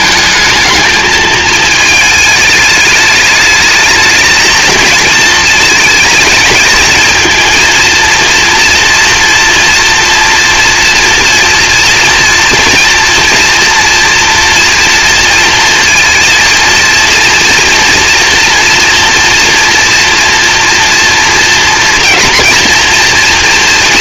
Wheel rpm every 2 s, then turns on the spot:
220, 210, 220, 230, 230, 230, 230, 230, 230, 240, 230, 230.
none